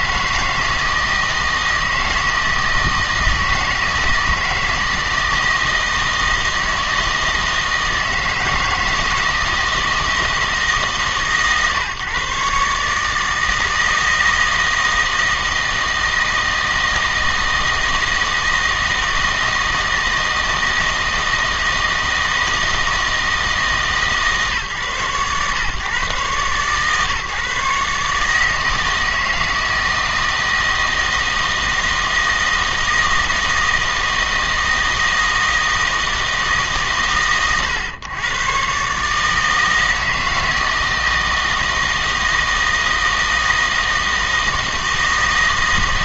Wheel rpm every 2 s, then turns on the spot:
160, 160, 160, 160, 160, 150, 150, 160, 160, 160, 160, 160, 130, 130, 160, 160, 160, 160, 140, 140, 160, 160, 160.
none